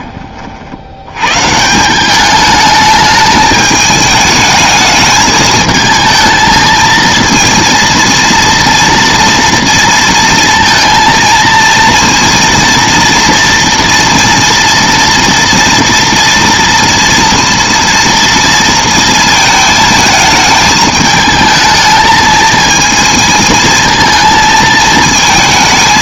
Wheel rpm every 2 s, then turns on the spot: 60, 210, 220, 220, 230, 230, 230, 230, 230, 230, 220, 220, 220.
none